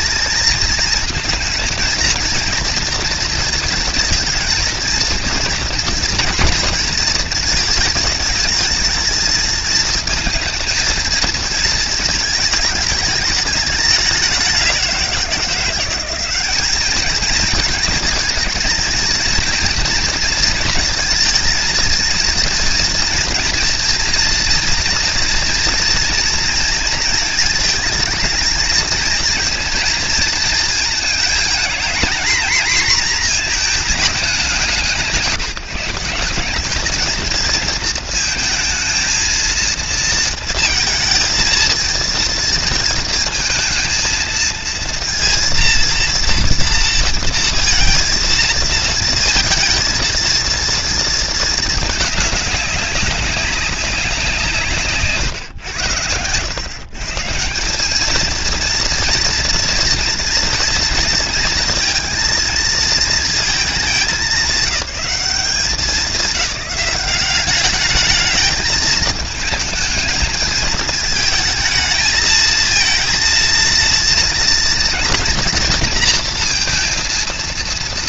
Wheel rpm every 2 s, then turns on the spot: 220, 230, 230, 230, 220, 230, 220, 180, 210, 220, 230, 230, 230, 230, 220, 220, 240, 160, 210, 230, 220, 230, 230, 230, 220, 230, 200, 140, 140, 230, 230, 230, 200, 190, 210, 220, 230, 230, 230.
none